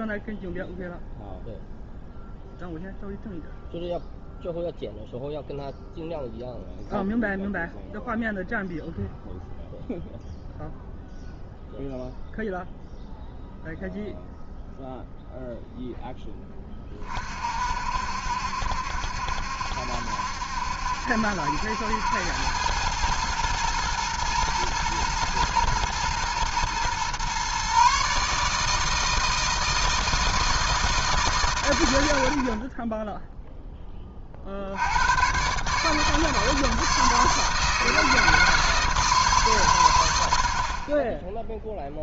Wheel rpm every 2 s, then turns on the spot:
0, 0, 0, 0, 0, 0, 0, 0, 30, 70, 70, 100, 120, 120, 160, 160, 40, 70, 160, 160, 50.
none